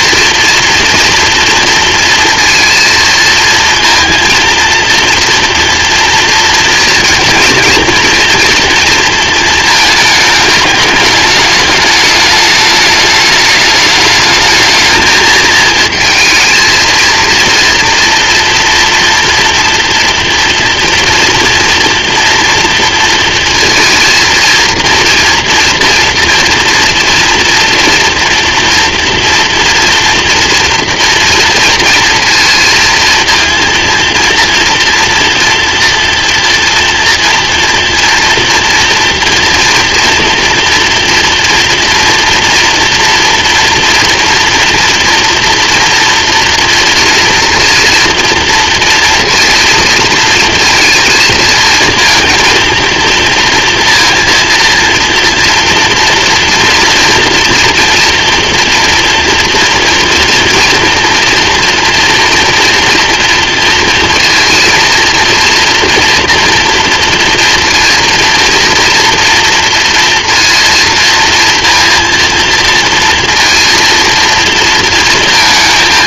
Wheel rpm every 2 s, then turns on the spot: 230, 230, 230, 230, 230, 210, 210, 210, 220, 230, 230, 230, 230, 230, 230, 240, 230, 240, 230, 230, 230, 230, 230, 240, 230, 230, 230, 230, 230, 230, 230, 230, 230, 230, 230, 230, 230, 230.
none